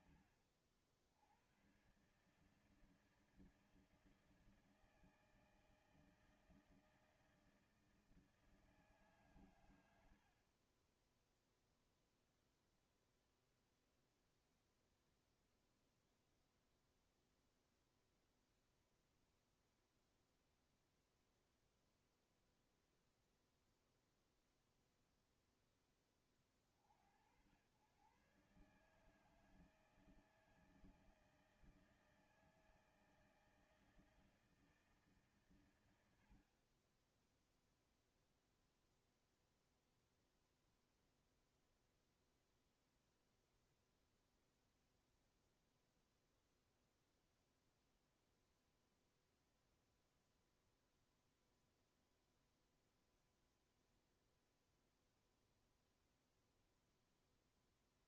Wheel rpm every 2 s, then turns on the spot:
90, 160, 160, 160, 150, 30, 0, 0, 0, 0, 0, 0, 0, 50, 140, 160, 160, 150, 30, 0, 0, 0, 0, 0, 0, 0, 0, 0, 0.
none